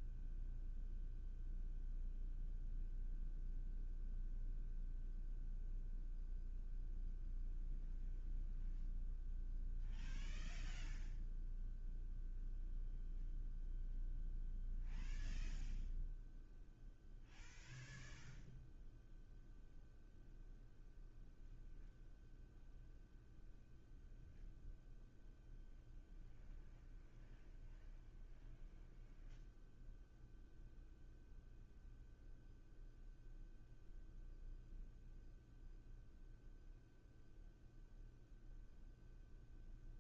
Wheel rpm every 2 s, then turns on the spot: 0, 0, 0, 0, 0, 0, 0, 0, 0, 0, 0, 0, 0, 0, 0, 0, 0, 0, 0, 0.
none